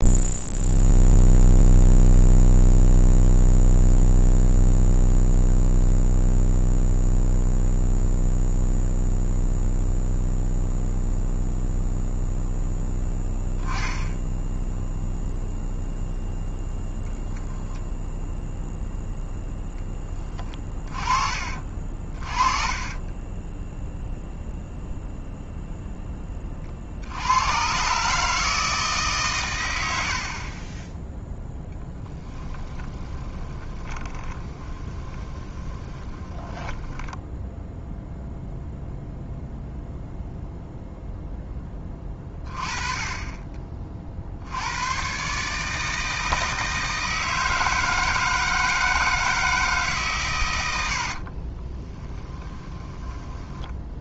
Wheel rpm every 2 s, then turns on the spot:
0, 0, 0, 0, 0, 0, 0, 0, 0, 0, 20, 30, 0, 40, 160, 20, 20, 20, 10, 0, 0, 30, 100, 160, 160, 90, 10.
22-24 32-38 52-54